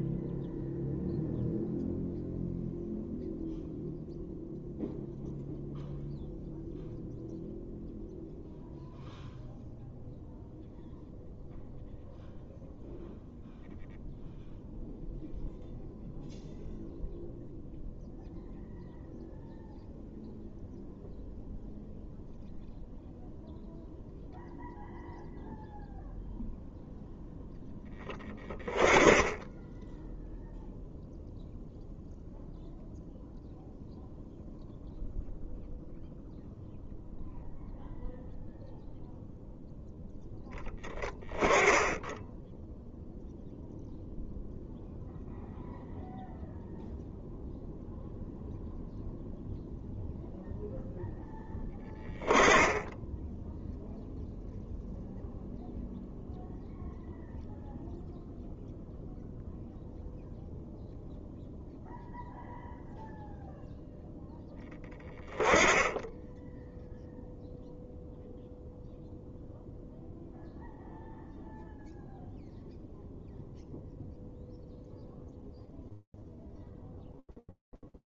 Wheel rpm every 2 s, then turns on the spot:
0, 0, 0, 0, 0, 0, 0, 0, 0, 0, 0, 0, 0, 0, 20, 0, 0, 0, 0, 0, 10, 0, 0, 0, 0, 0, 10, 0, 0, 0, 0, 0, 10, 10, 0, 0, 0, 0, 0.
none